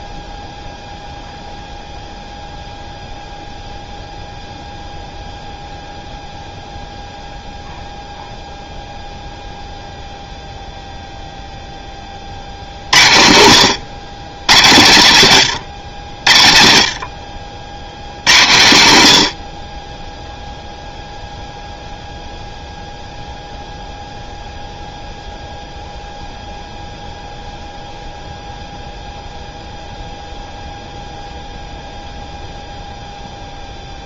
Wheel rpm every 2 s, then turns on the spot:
0, 0, 0, 0, 0, 0, 60, 100, 60, 90, 0, 0, 0, 0, 0, 0, 0.
none